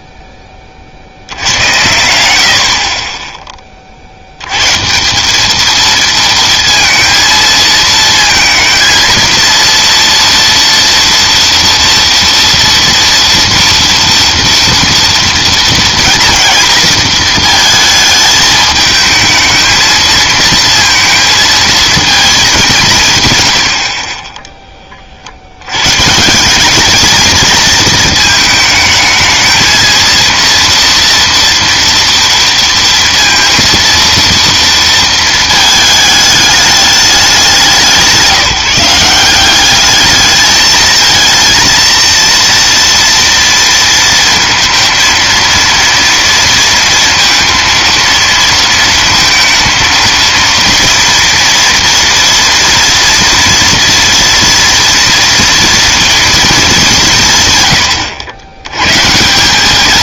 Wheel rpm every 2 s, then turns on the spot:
30, 50, 150, 230, 230, 240, 230, 230, 230, 220, 230, 180, 30, 210, 220, 230, 230, 230, 200, 170, 220, 230, 230, 230, 230, 230, 230, 230, 190, 140.
none